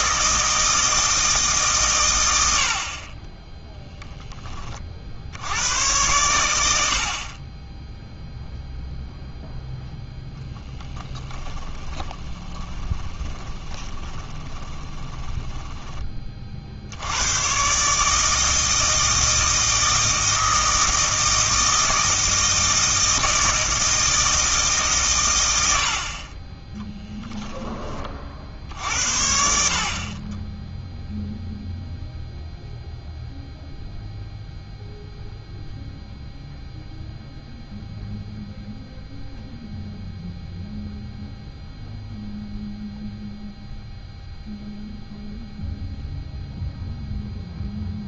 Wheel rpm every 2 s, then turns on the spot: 160, 60, 30, 70, 0, 10, 20, 20, 70, 160, 160, 160, 140, 10, 70, 0, 0, 0, 0, 0, 0, 0, 0, 0.
10-16 26-28